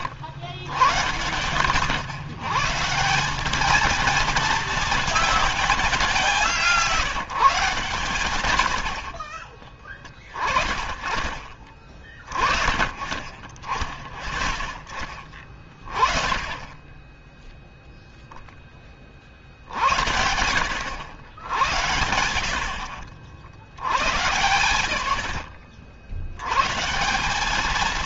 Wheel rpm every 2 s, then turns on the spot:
100, 150, 230, 180, 80, 20, 30, 30, 20, 20, 80, 60, 100, 120.
none